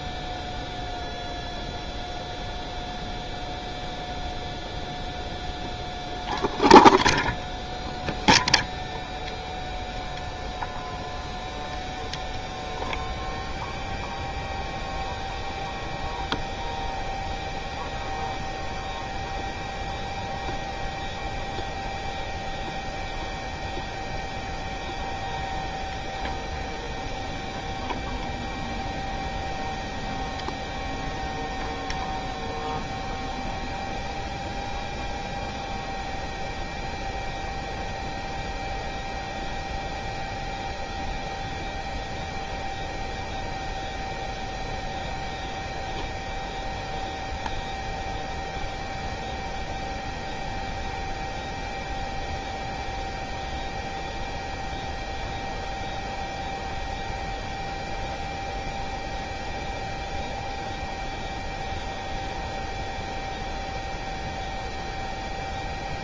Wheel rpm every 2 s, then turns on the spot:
0, 0, 0, 0, 0, 0, 0, 0, 0, 0, 0, 0, 0, 0, 0, 0, 0, 0, 0, 0, 0, 0, 0, 0, 0, 0, 0, 0, 0, 0, 0, 0, 0.
none